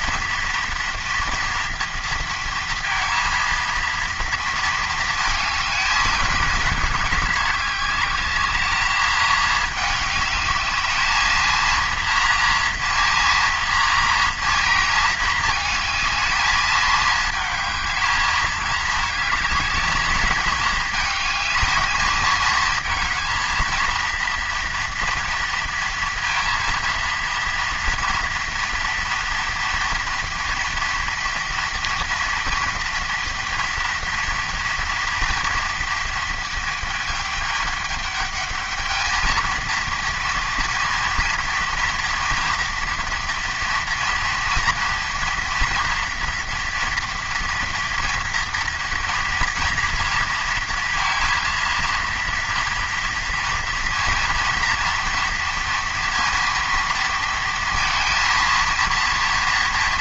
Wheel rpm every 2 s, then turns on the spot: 230, 230, 230, 210, 210, 210, 230, 230, 220, 220, 220, 220, 230, 230, 230, 230, 230, 240, 220, 210, 230, 230, 230, 230, 230, 230, 230, 230, 230, 230.
none